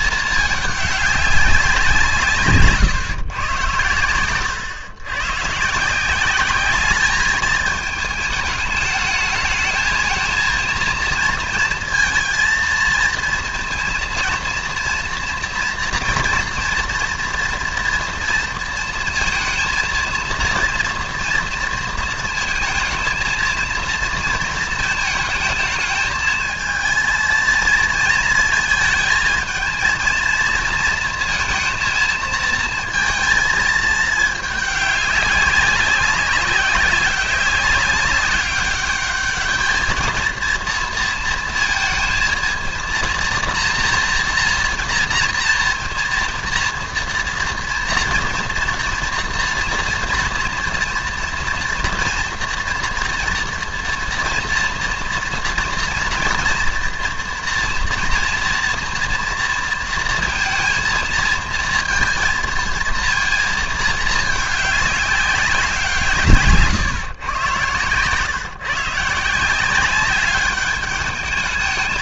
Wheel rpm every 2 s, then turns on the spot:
210, 140, 110, 200, 220, 230, 230, 230, 230, 230, 230, 230, 220, 220, 220, 230, 220, 210, 200, 200, 230, 230, 230, 230, 230, 230, 240, 230, 230, 230, 230, 230, 210, 140, 140, 200.
none